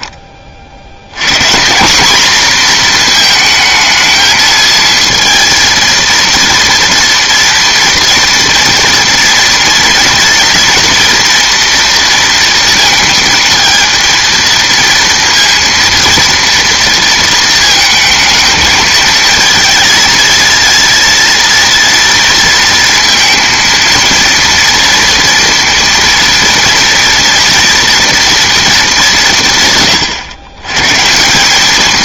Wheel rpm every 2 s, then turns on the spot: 30, 220, 220, 230, 230, 230, 230, 230, 230, 220, 230, 230, 230, 230, 230, 130.
none